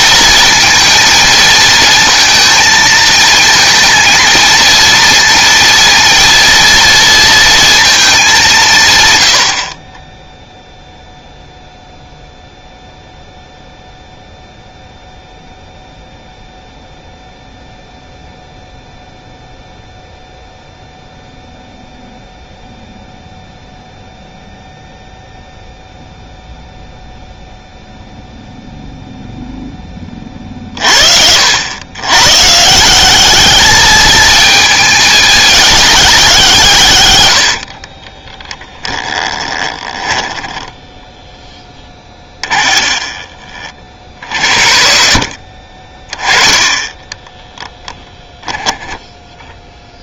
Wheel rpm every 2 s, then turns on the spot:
230, 220, 230, 230, 170, 0, 0, 0, 0, 0, 0, 0, 0, 0, 0, 40, 160, 220, 150, 20, 10, 30, 60, 20, 10.
38-44 46-48